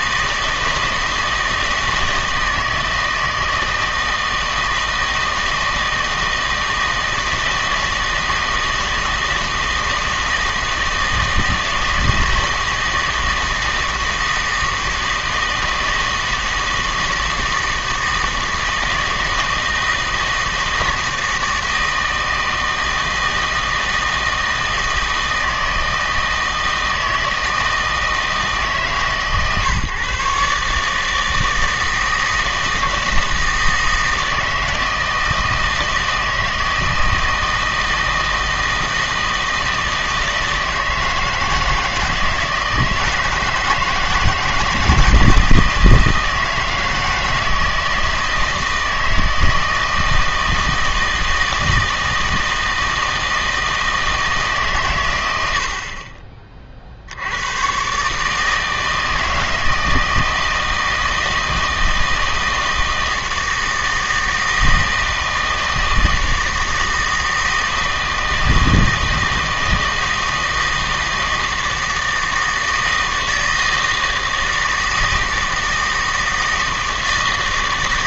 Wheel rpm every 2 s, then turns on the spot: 160, 160, 160, 160, 160, 160, 160, 160, 160, 160, 160, 160, 160, 160, 150, 150, 160, 160, 160, 160, 160, 170, 160, 160, 160, 160, 160, 150, 40, 160, 160, 160, 160, 160, 160, 160, 160, 160, 160.
none